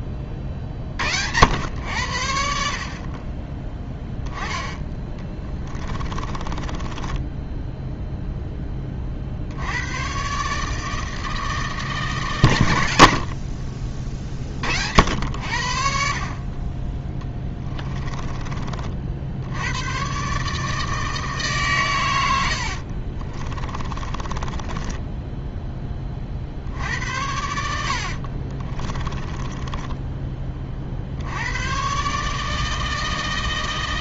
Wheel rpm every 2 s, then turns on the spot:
50, 50, 10, 20, 20, 150, 100, 60, 30, 40, 150, 60, 20, 60, 20, 40, 160.
6-8 22-26 28-30